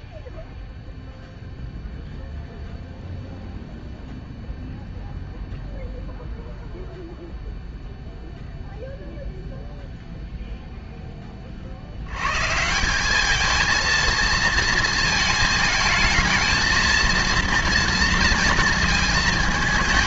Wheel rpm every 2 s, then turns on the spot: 0, 0, 0, 0, 0, 0, 150, 230, 230, 230.
none